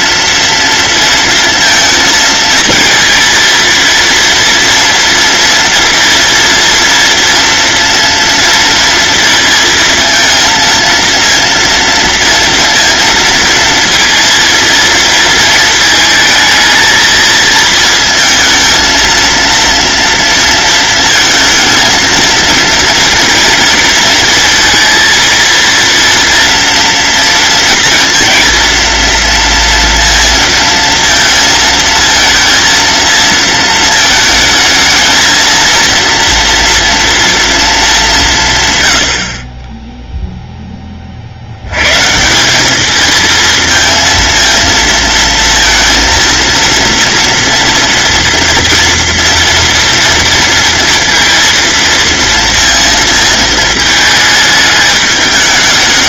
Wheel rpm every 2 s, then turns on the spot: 230, 230, 230, 230, 230, 230, 230, 230, 220, 220, 230, 230, 230, 230, 230, 230, 220, 220, 230, 110, 20, 200, 230, 230, 230, 230, 230, 210.
none